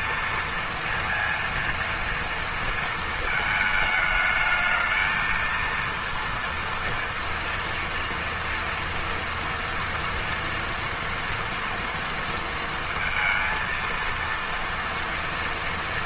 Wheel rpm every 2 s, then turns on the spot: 230, 230, 220, 230, 230, 230, 230, 230.
none